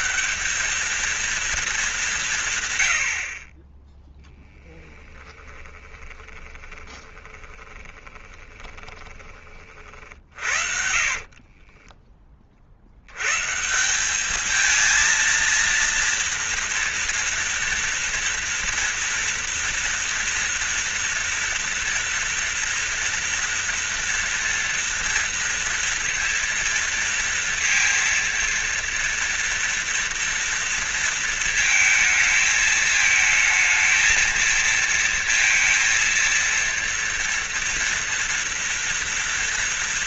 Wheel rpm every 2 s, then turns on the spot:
220, 110, 10, 20, 20, 50, 70, 220, 240, 230, 230, 230, 230, 230, 230, 230, 220, 230, 230, 230.
4-12